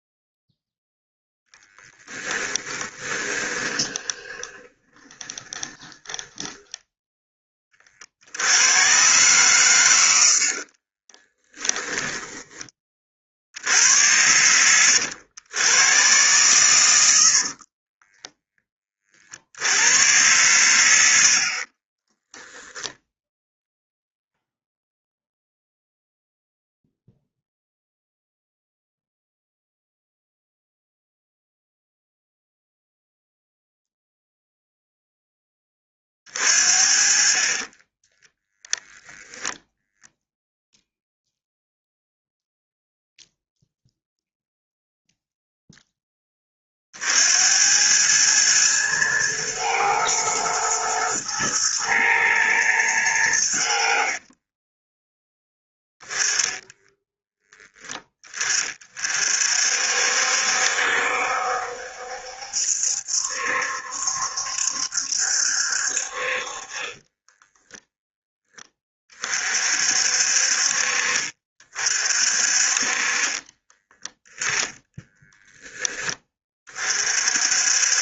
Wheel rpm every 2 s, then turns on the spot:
0, 20, 20, 10, 120, 40, 40, 90, 100, 30, 70, 0, 0, 0, 0, 0, 0, 0, 40, 0, 0, 0, 0, 50, 110, 110, 100, 10, 10, 40, 70, 70, 70, 30, 30, 50, 40, 10, 40.
2-6 10-12 66-68 74-76